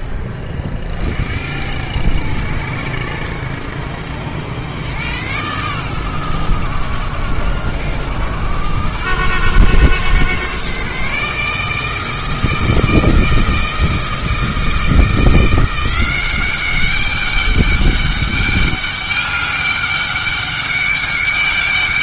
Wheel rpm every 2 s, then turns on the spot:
40, 70, 100, 100, 110, 140, 160, 160, 190, 200, 200.
none